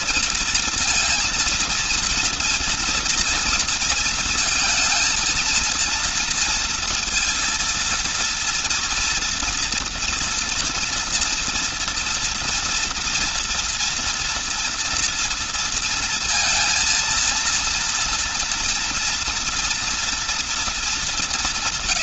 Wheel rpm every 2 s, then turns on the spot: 230, 230, 230, 230, 230, 230, 240, 230, 230, 230, 230.
none